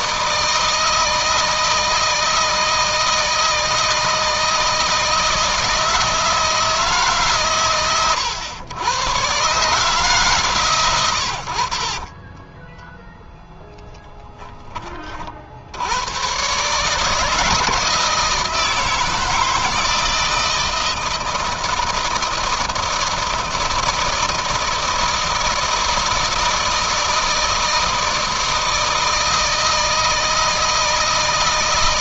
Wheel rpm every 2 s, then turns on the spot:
160, 160, 160, 150, 120, 130, 20, 30, 140, 160, 160, 160, 160, 160, 160, 160.
12-14